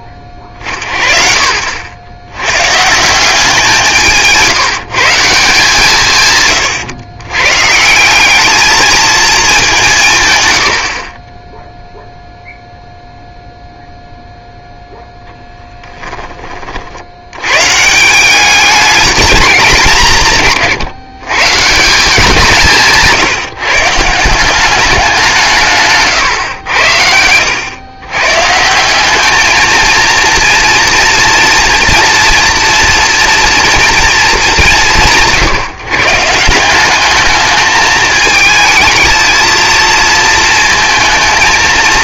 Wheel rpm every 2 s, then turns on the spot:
40, 170, 170, 110, 220, 70, 0, 0, 50, 210, 140, 160, 190, 90, 180, 230, 240, 190, 190, 220, 220.
none